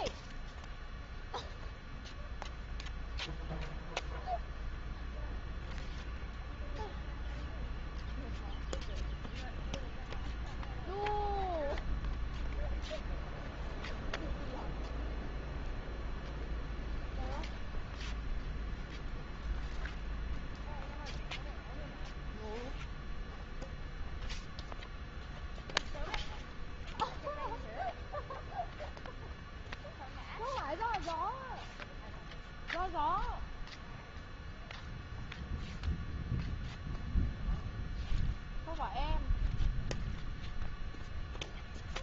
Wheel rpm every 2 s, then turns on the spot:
0, 0, 0, 0, 0, 0, 0, 0, 0, 0, 0, 0, 0, 0, 0, 0, 0, 0, 0, 0, 0.
none